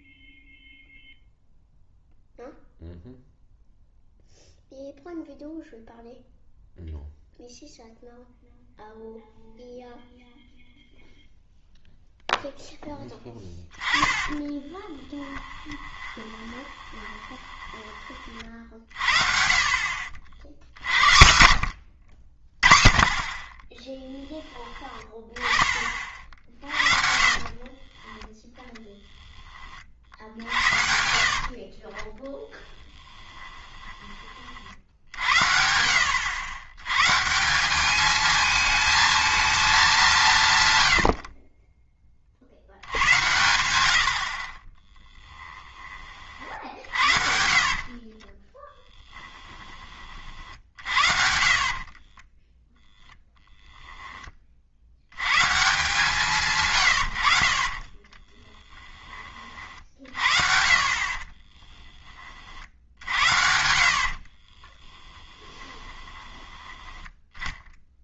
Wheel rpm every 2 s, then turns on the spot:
0, 0, 0, 0, 0, 0, 10, 30, 20, 50, 80, 30, 20, 50, 10, 70, 20, 60, 100, 220, 110, 130, 30, 60, 10, 60, 0, 50, 130, 10, 50, 60, 30, 10.
14-18 30-34 40-42 46-50 58-60 64-66